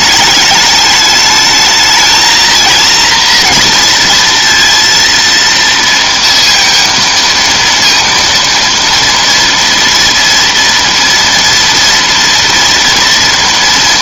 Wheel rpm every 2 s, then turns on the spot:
210, 230, 230, 230, 230, 230, 230.
none